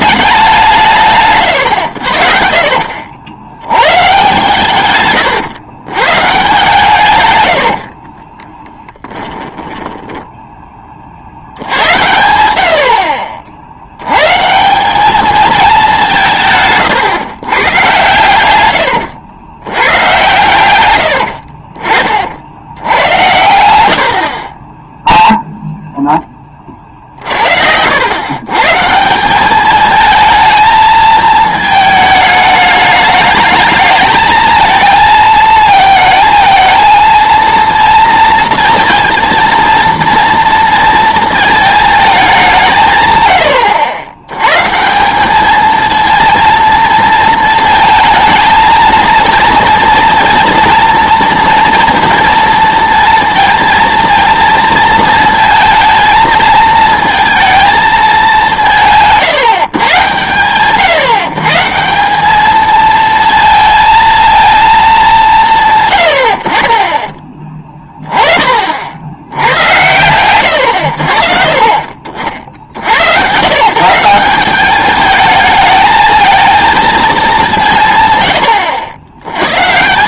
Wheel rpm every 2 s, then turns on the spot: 170, 50, 120, 140, 20, 20, 60, 170, 150, 100, 90, 80, 20, 40, 160, 220, 210, 220, 220, 230, 230, 160, 150, 230, 220, 230, 230, 230, 220, 170, 130, 220, 220, 50, 50, 100, 80, 200, 230, 100.
8-10 26-28